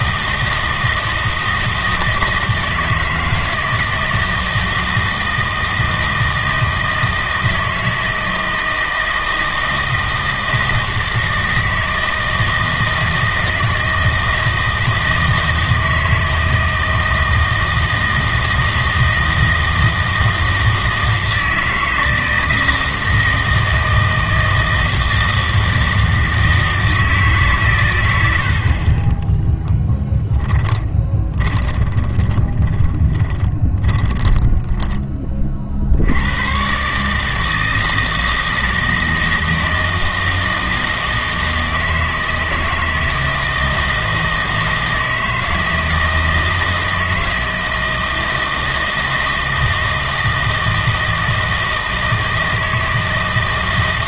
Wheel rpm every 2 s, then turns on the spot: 160, 160, 160, 160, 160, 160, 160, 160, 160, 160, 160, 160, 160, 160, 30, 20, 20, 10, 130, 160, 160, 160, 160, 160, 160, 160, 160.
30-36